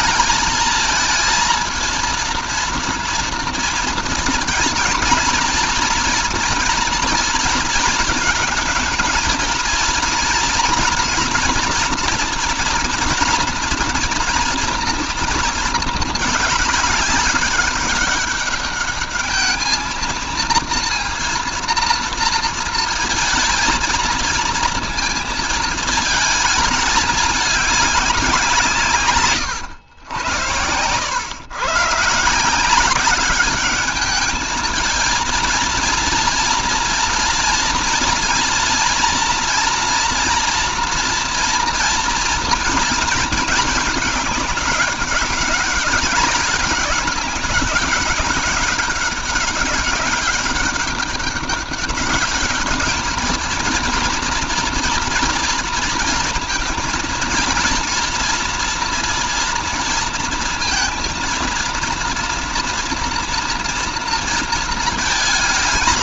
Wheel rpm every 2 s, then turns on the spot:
220, 230, 230, 240, 220, 240, 240, 230, 210, 200, 230, 230, 230, 220, 170, 110, 190, 220, 230, 230, 230, 220, 200, 200, 200, 200, 200, 240, 230, 240, 230, 230, 230.
none